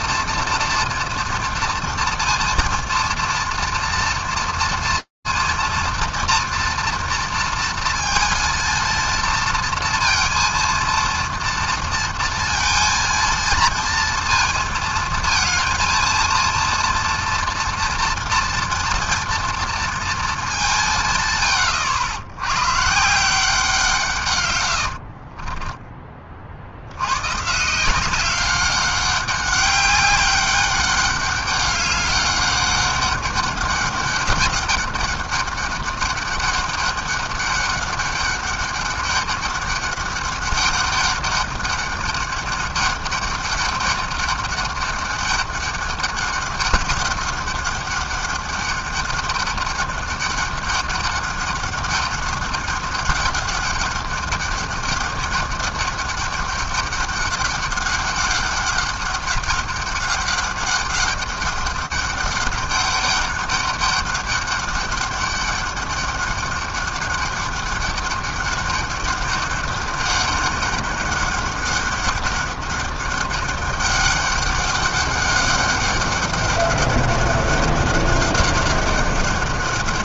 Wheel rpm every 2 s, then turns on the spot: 230, 230, 230, 230, 230, 230, 230, 230, 230, 230, 190, 120, 100, 60, 190, 200, 200, 200, 200, 200, 200, 200, 200, 200, 200, 200, 200, 200, 200, 200, 200, 200, 200, 200, 200, 200, 200, 200, 200, 200.
24-26